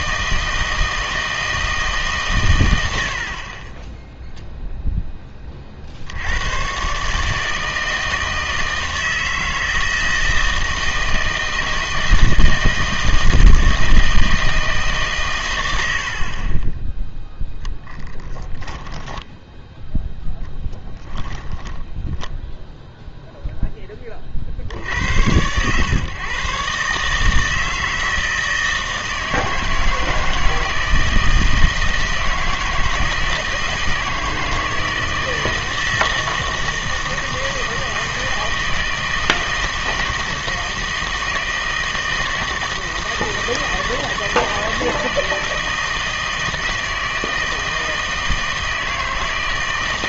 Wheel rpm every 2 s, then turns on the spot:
160, 120, 0, 120, 160, 160, 160, 160, 20, 10, 0, 0, 70, 140, 160, 160, 160, 160, 160, 160, 160, 160, 160, 160, 160.
16-20